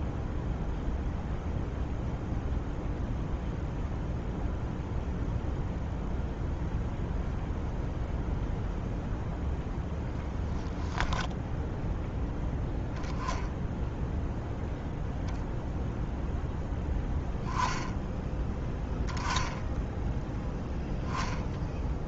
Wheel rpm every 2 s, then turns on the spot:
0, 0, 0, 0, 0, 0, 0, 0, 10, 10, 0.
none